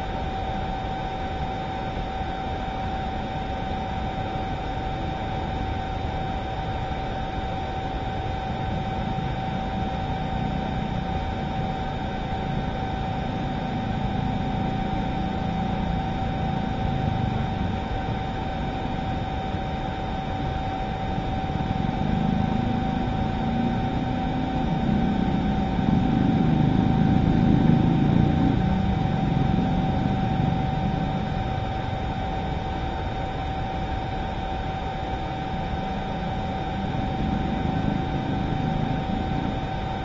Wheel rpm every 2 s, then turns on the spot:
0, 0, 0, 0, 0, 0, 0, 0, 0, 0, 0, 0, 0, 0, 0, 0, 0, 0, 0, 0.
none